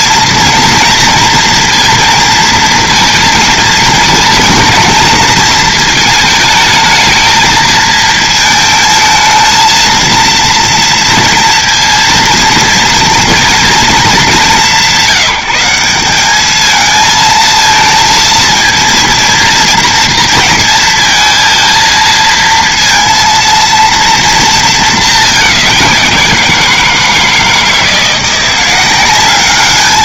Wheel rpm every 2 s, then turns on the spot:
230, 230, 230, 220, 220, 230, 230, 190, 220, 220, 220, 230, 220, 170, 180.
none